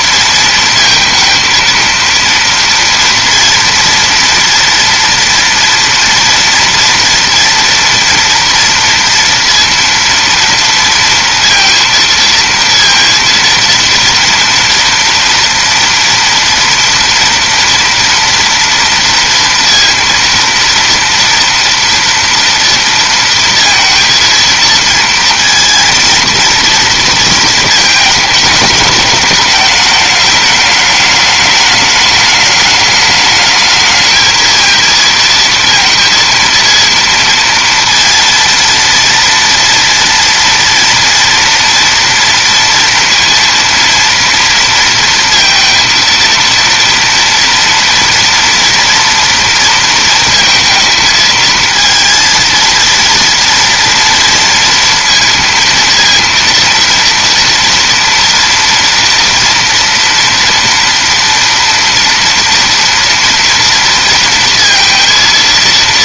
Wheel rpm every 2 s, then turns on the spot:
230, 230, 230, 230, 230, 230, 230, 230, 230, 230, 230, 230, 230, 230, 210, 210, 210, 230, 230, 230, 230, 230, 230, 230, 230, 220, 230, 230, 230, 230, 230, 230, 230.
none